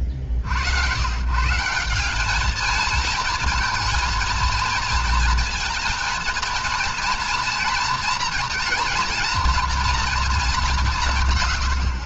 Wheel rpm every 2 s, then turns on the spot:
70, 220, 230, 230, 230, 200.
none